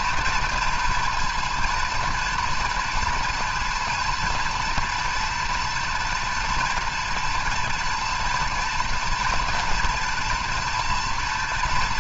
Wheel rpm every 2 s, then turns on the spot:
230, 230, 230, 240, 230, 240.
none